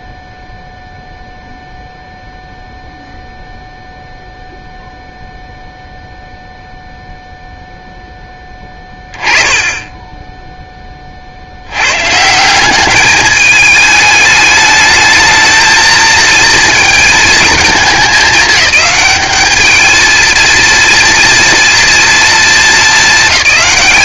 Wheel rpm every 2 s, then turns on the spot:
0, 0, 0, 0, 10, 10, 180, 220, 230, 210, 230, 220.
none